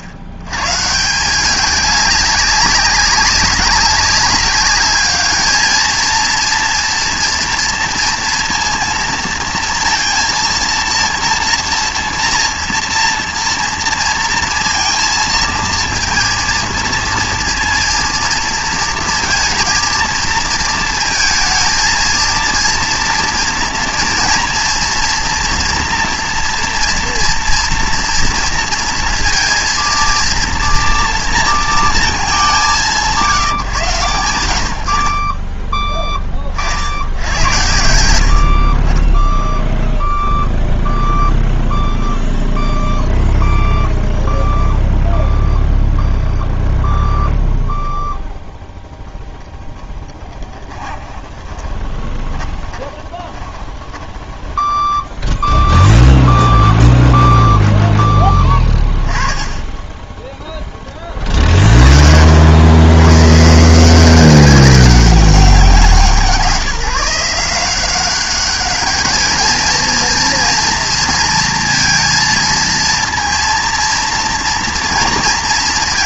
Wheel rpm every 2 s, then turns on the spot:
120, 200, 200, 230, 230, 230, 230, 230, 230, 230, 230, 230, 230, 230, 230, 230, 190, 80, 60, 50, 0, 0, 0, 0, 0, 20, 20, 10, 0, 30, 10, 90, 190, 180, 200, 230, 230, 230.
50-56